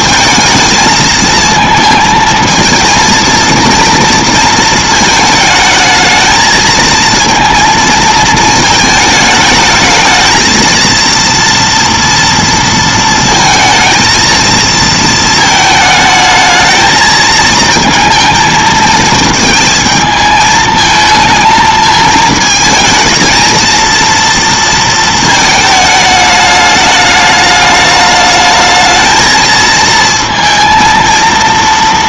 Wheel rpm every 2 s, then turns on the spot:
220, 230, 230, 220, 220, 230, 230, 230, 220, 220, 220, 220, 230, 210, 220, 230.
none